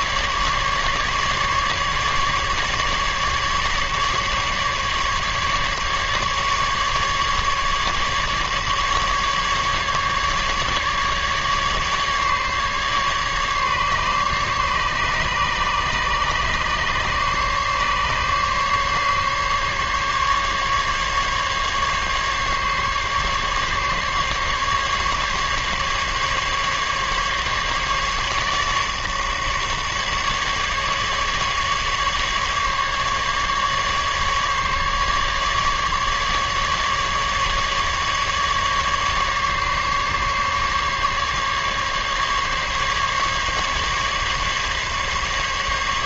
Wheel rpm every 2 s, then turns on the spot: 150, 150, 140, 150, 150, 150, 140, 140, 140, 140, 140, 140, 140, 140, 150, 150, 140, 140, 150, 140, 140, 140, 140.
none